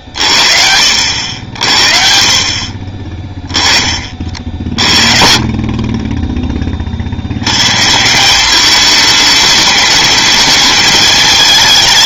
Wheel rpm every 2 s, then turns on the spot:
70, 40, 60, 30, 210, 220.
none